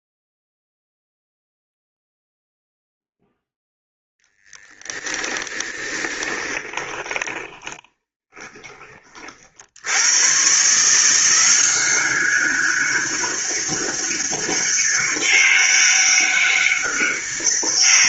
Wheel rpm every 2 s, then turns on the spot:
0, 0, 0, 30, 20, 110, 190, 200, 200.
6-10